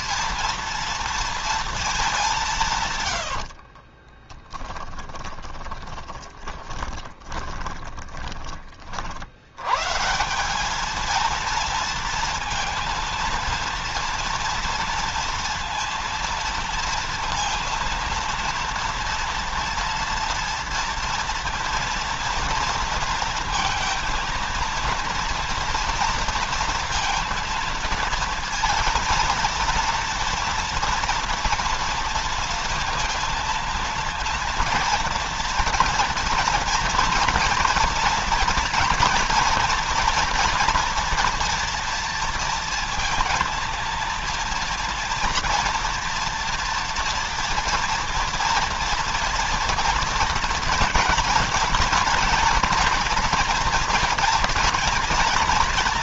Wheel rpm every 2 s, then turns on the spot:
230, 150, 20, 20, 40, 210, 230, 230, 230, 230, 230, 230, 230, 230, 230, 230, 230, 230, 220, 230, 230, 230, 230, 240, 230, 230, 240, 230.
2-8